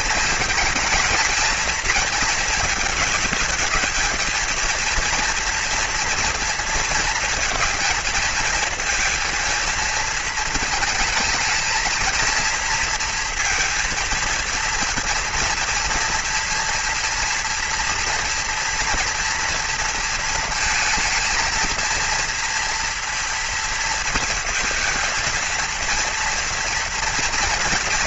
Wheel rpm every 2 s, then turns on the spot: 230, 220, 230, 230, 230, 220, 230, 230, 230, 230, 230, 230, 230, 230.
none